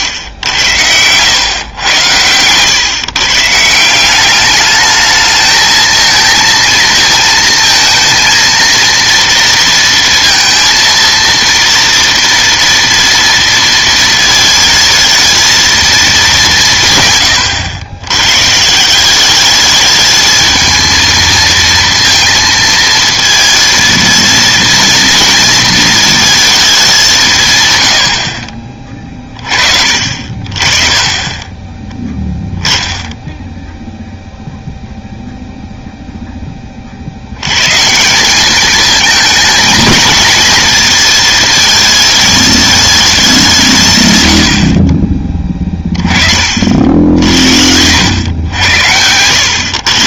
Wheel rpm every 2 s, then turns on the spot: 100, 120, 210, 230, 230, 230, 230, 220, 180, 150, 220, 230, 230, 210, 40, 40, 10, 0, 30, 210, 220, 220, 70, 50, 100.
46-48